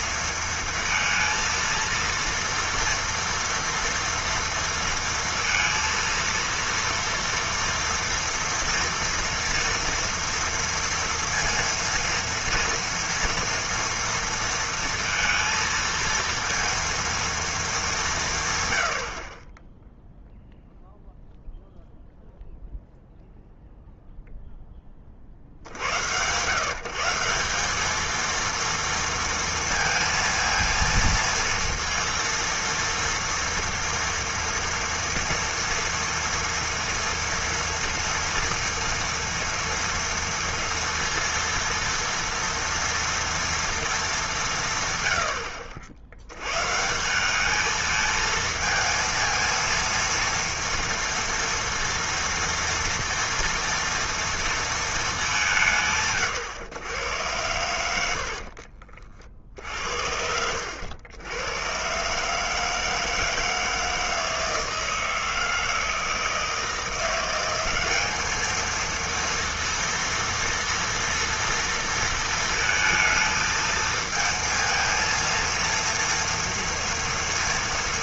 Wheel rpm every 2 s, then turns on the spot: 230, 230, 230, 230, 230, 230, 230, 230, 230, 110, 0, 0, 10, 150, 230, 230, 230, 230, 230, 230, 230, 230, 150, 140, 230, 230, 230, 230, 110, 50, 80, 150, 160, 160, 220, 230, 220, 220, 230.
58-60